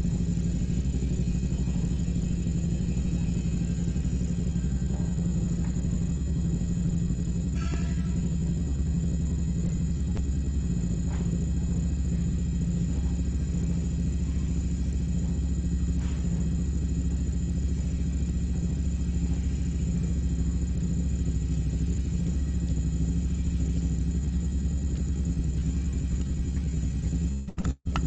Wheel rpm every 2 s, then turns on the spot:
0, 0, 0, 0, 0, 0, 0, 0, 0, 0, 0, 0, 0, 0.
none